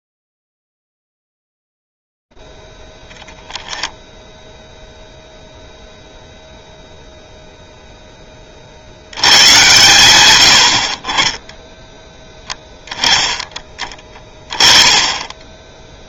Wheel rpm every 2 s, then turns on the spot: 10, 10, 0, 0, 40, 80, 10, 20.
none